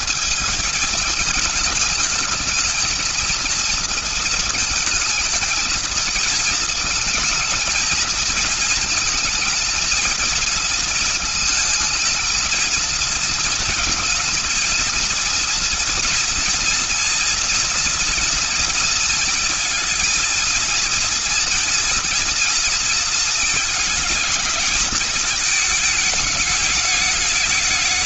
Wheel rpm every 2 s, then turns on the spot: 220, 230, 220, 220, 220, 230, 220, 230, 230, 220, 240, 230, 220, 210.
none